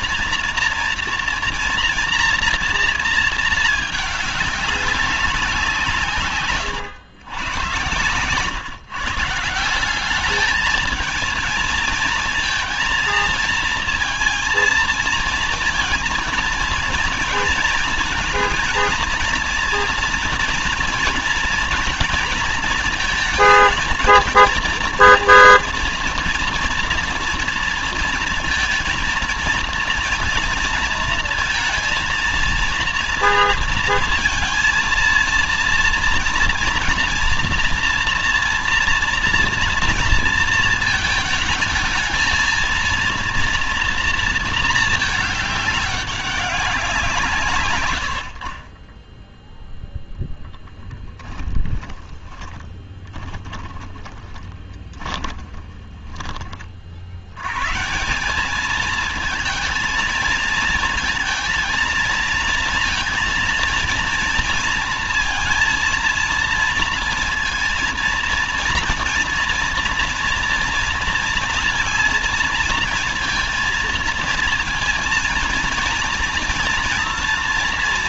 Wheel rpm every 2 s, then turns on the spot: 230, 240, 200, 140, 130, 210, 220, 230, 220, 230, 230, 230, 230, 240, 230, 230, 230, 230, 230, 230, 220, 220, 230, 200, 60, 10, 30, 20, 30, 200, 220, 230, 230, 230, 230, 240, 230, 230, 230.
52-56